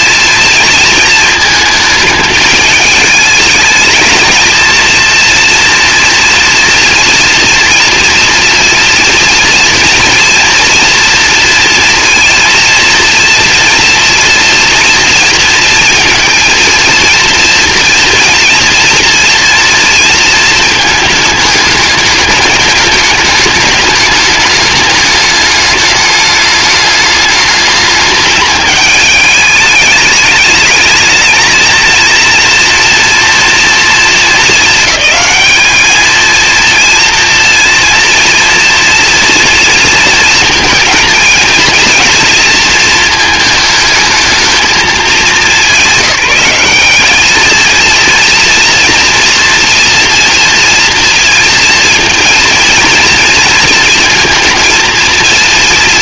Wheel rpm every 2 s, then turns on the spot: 230, 210, 220, 230, 230, 230, 230, 230, 230, 230, 220, 210, 210, 210, 210, 210, 230, 210, 230, 240, 230, 230, 220, 200, 240, 230, 230, 230.
none